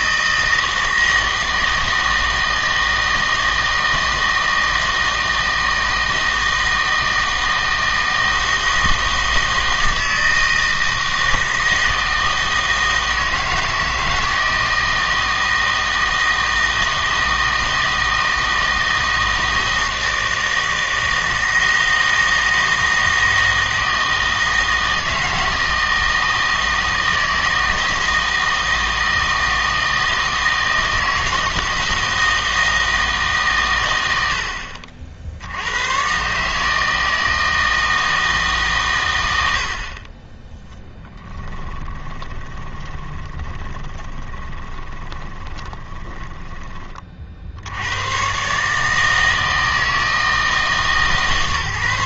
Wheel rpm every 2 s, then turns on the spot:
160, 160, 160, 160, 160, 160, 160, 160, 160, 160, 160, 160, 160, 160, 160, 160, 160, 70, 150, 130, 10, 20, 20, 20, 140, 160.
42-46